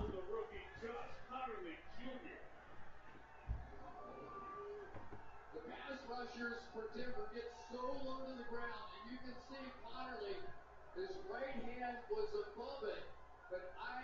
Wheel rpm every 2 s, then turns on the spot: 0, 0, 0, 0, 0, 0, 0.
none